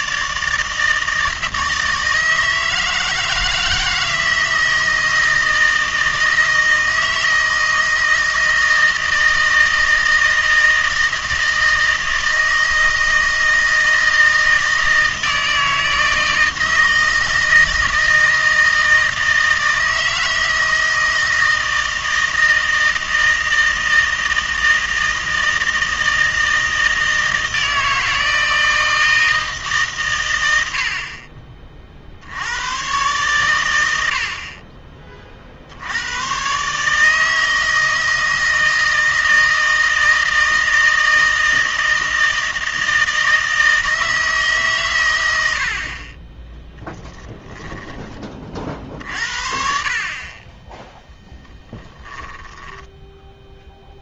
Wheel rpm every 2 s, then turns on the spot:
160, 160, 160, 160, 160, 160, 160, 160, 160, 160, 160, 160, 160, 160, 160, 80, 110, 30, 140, 160, 160, 160, 140, 10, 50, 10, 10.
46-48 52-54